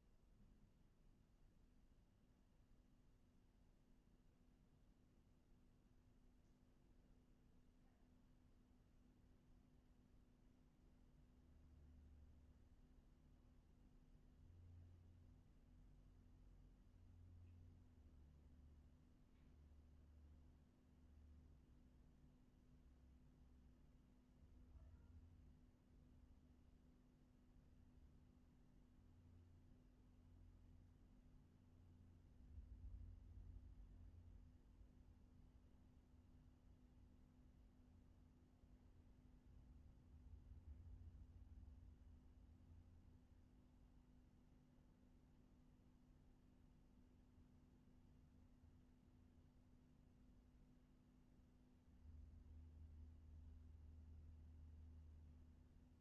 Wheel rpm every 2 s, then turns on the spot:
0, 0, 0, 0, 0, 0, 0, 0, 0, 0, 0, 0, 0, 0, 0, 0, 0, 0, 0, 0, 0, 0, 0, 0, 0, 0, 0, 0.
none